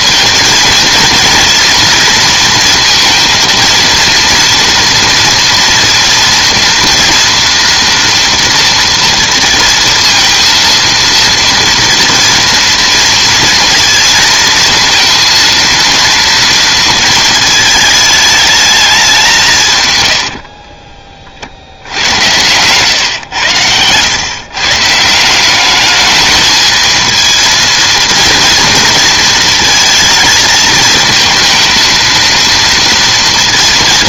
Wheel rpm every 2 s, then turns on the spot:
230, 230, 230, 240, 230, 230, 230, 220, 230, 210, 40, 110, 140, 220, 230, 220, 230.
20-22